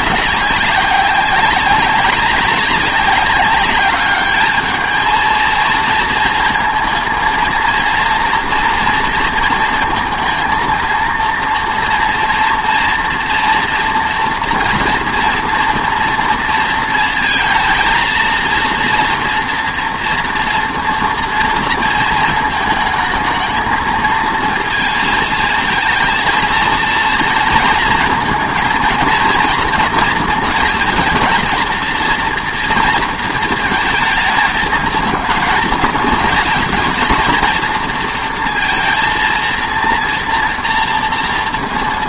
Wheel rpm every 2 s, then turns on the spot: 190, 190, 210, 230, 240, 230, 240, 230, 230, 230, 230, 220, 230, 230, 230, 230, 230, 220, 220, 230, 240.
none